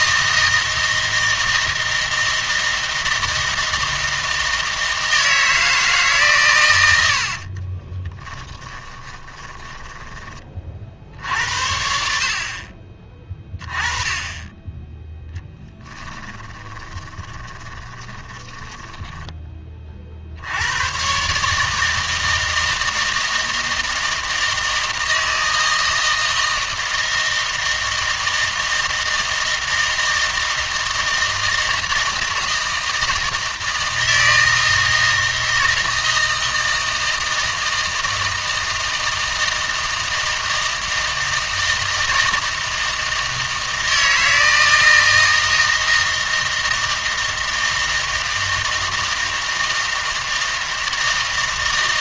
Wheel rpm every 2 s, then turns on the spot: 160, 160, 160, 100, 20, 40, 30, 10, 20, 20, 110, 160, 160, 160, 160, 160, 160, 160, 160, 160, 160, 160, 160, 160, 160, 160.
8-10 16-20